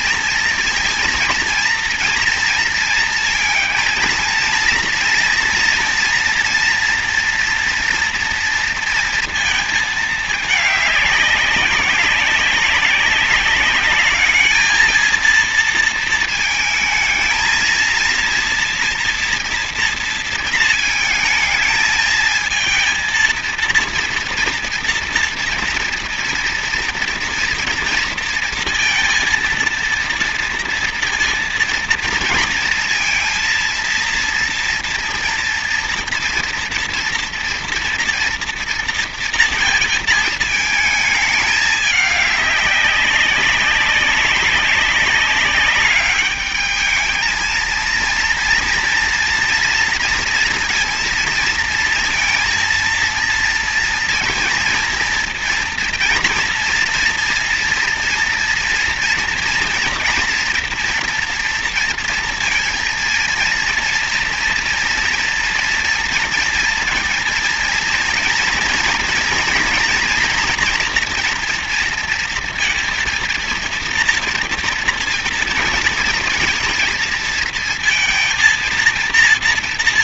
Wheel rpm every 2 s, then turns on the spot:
230, 230, 230, 230, 230, 220, 200, 210, 220, 230, 230, 230, 230, 230, 230, 230, 230, 230, 230, 230, 220, 200, 200, 210, 230, 230, 230, 230, 230, 230, 240, 230, 230, 230, 230, 230, 230, 230, 220, 230.
none